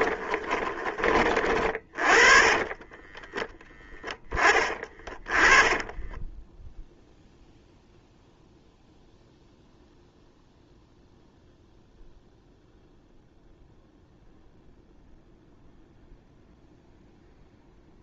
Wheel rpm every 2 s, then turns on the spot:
30, 10, 20, 0, 0, 0, 0, 0, 0.
2-6